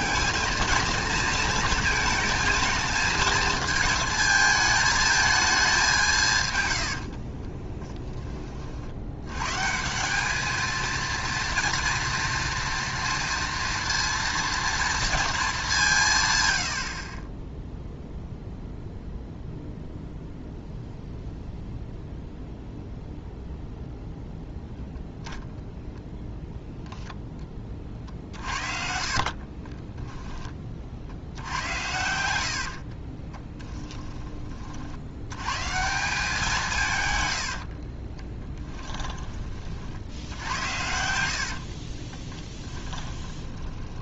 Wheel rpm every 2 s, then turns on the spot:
230, 220, 220, 90, 50, 220, 230, 230, 70, 0, 0, 0, 0, 0, 50, 40, 50, 50, 160, 20, 80, 10.
6-8 16-18 28-30 32-34 38-44